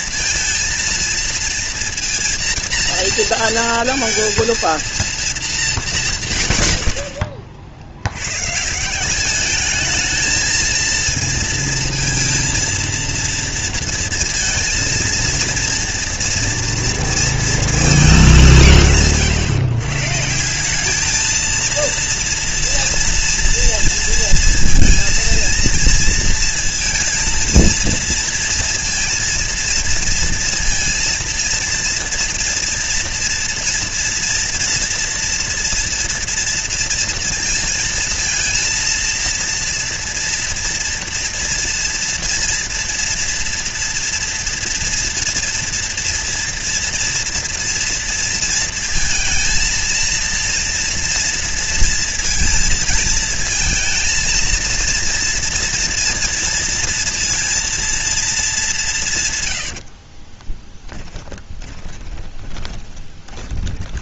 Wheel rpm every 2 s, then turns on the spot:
230, 230, 230, 110, 140, 220, 230, 230, 230, 180, 170, 230, 230, 230, 230, 230, 230, 230, 230, 230, 230, 240, 240, 230, 230, 230, 230, 230, 230, 210, 20, 20.
60-64